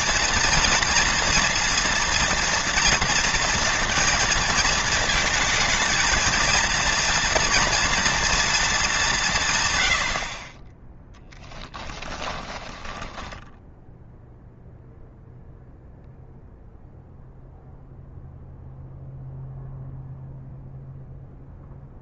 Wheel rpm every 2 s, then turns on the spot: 240, 230, 220, 230, 200, 10, 10, 0, 0, 0, 0.
12-14